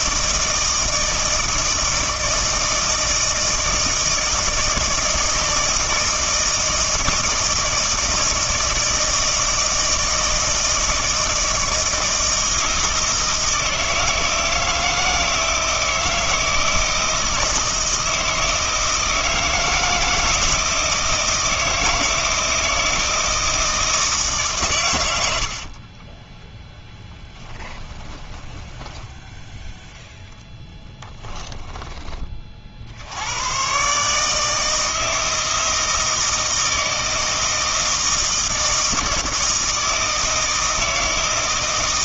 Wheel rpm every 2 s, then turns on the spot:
160, 160, 160, 160, 160, 160, 160, 160, 160, 160, 160, 160, 120, 10, 10, 10, 60, 160, 160, 160, 160.
28-32